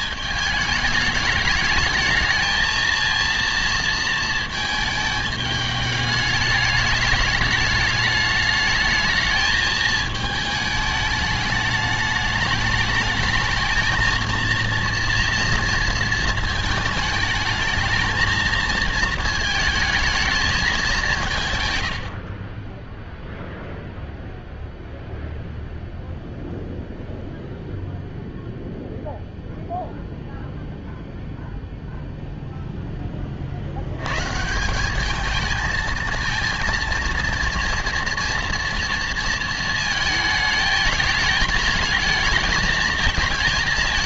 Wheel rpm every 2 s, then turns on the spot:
210, 220, 220, 210, 220, 210, 210, 230, 220, 230, 220, 30, 0, 0, 0, 0, 0, 170, 230, 230, 220, 220.
none